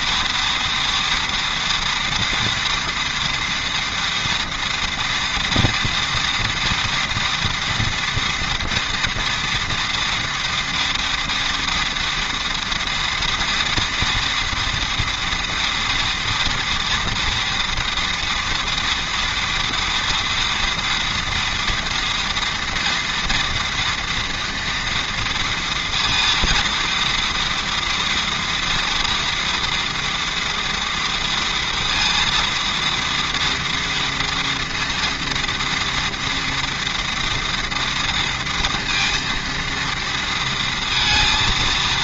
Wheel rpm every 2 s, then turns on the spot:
240, 240, 240, 240, 230, 230, 230, 230, 230, 230, 230, 230, 230, 230, 240, 230, 230, 230, 230, 230, 230.
none